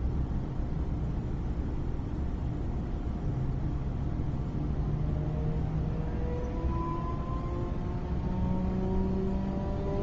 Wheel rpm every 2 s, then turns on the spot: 0, 0, 0, 0, 0.
none